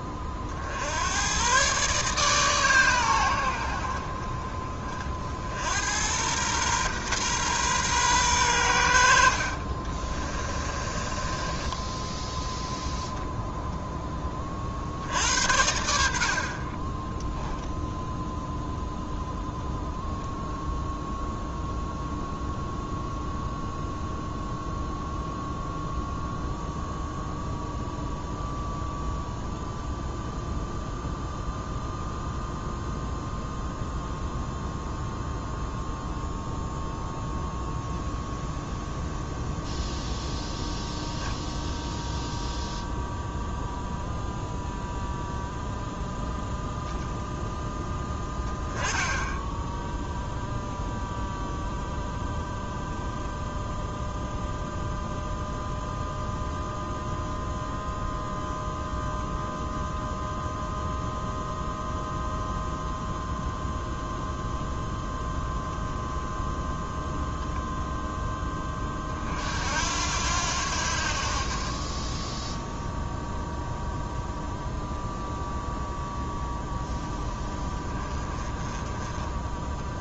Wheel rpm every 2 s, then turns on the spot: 50, 130, 40, 120, 90, 30, 0, 40, 30, 0, 10, 0, 0, 0, 0, 0, 0, 0, 0, 0, 0, 0, 0, 0, 0, 0, 0, 0, 0, 0, 0, 0, 0, 0, 20, 80, 0, 0, 0, 20.
10-12